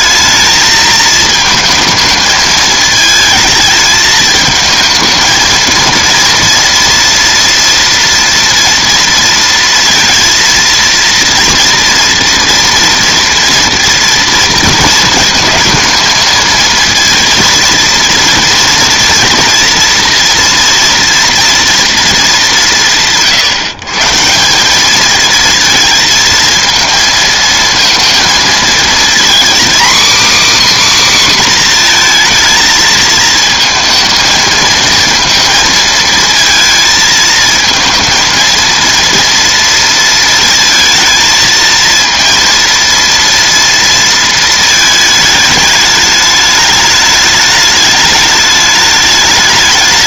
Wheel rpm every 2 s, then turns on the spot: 220, 220, 220, 230, 230, 230, 230, 230, 230, 230, 230, 190, 190, 230, 230, 280, 220, 220, 220, 230, 230, 230, 220, 210, 210.
none